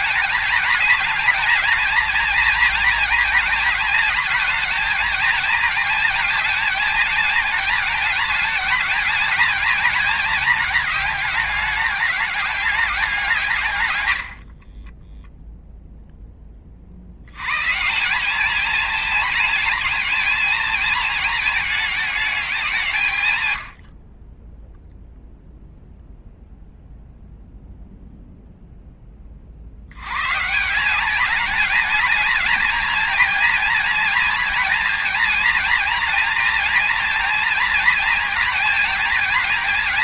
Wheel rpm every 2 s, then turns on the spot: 230, 230, 220, 220, 210, 210, 200, 20, 40, 220, 220, 180, 0, 0, 10, 190, 230, 230, 230, 220.
14-16